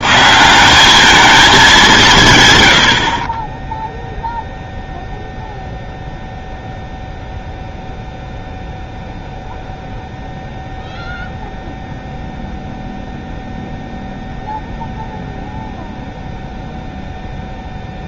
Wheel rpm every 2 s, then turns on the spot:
180, 110, 0, 0, 0, 0, 0, 0, 0.
none